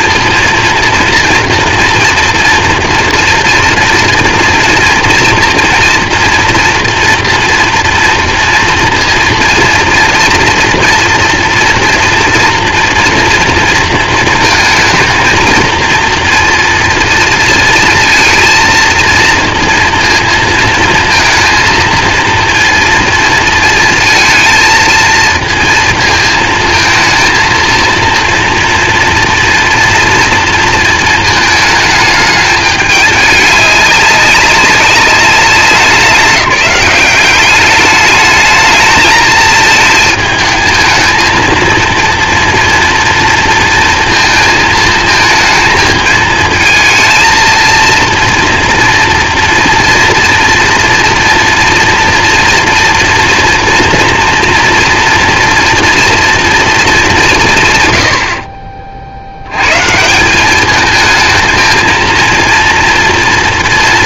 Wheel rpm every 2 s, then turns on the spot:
230, 230, 230, 240, 230, 230, 230, 220, 230, 230, 220, 230, 220, 230, 230, 220, 210, 200, 200, 220, 220, 230, 220, 220, 230, 230, 230, 230, 220, 40, 210, 230.
none